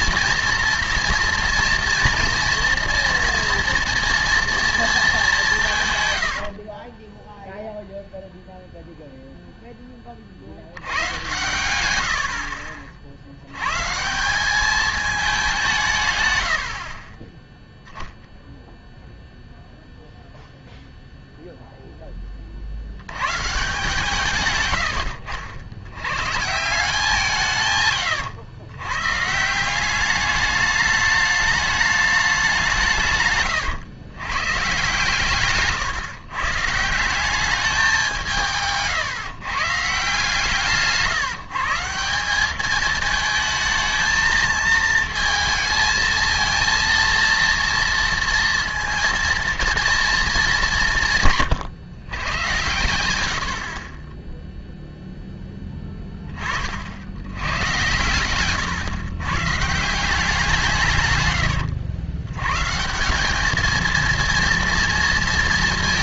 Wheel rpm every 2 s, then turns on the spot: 230, 230, 230, 50, 0, 90, 40, 210, 60, 0, 0, 70, 90, 160, 110, 210, 170, 120, 140, 150, 160, 210, 230, 230, 230, 190, 120, 0, 40, 130, 150, 130, 230.
6-8 24-26 40-42